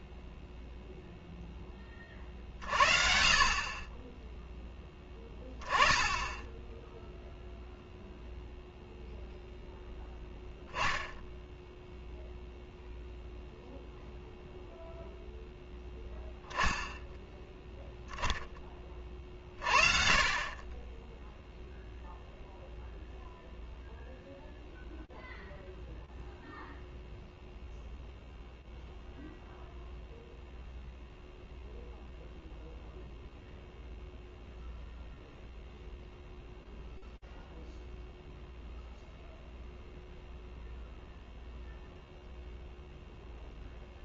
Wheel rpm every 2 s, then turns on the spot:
0, 40, 10, 10, 0, 10, 0, 0, 10, 10, 30, 0, 0, 0, 0, 0, 0, 0, 0, 0, 0, 0.
none